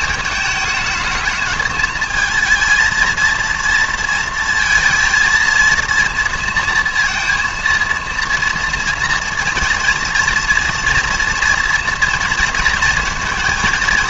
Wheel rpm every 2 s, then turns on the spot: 220, 230, 230, 230, 230, 230, 240.
none